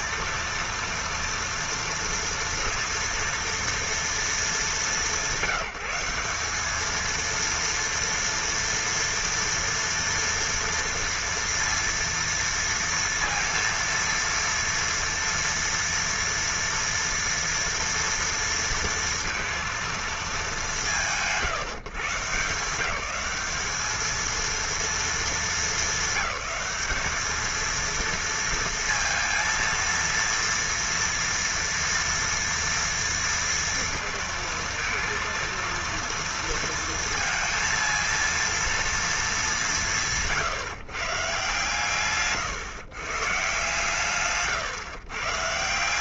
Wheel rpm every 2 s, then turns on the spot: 230, 230, 200, 210, 230, 230, 230, 230, 230, 230, 150, 160, 230, 200, 230, 230, 230, 230, 230, 230, 150, 130, 130.
none